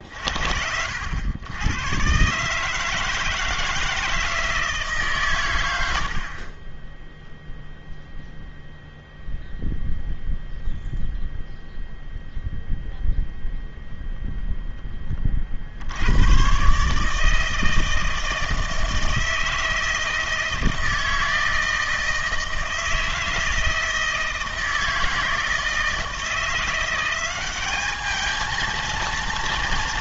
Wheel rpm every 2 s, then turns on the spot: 80, 160, 140, 0, 0, 0, 0, 20, 150, 160, 160, 160, 160, 180, 230.
none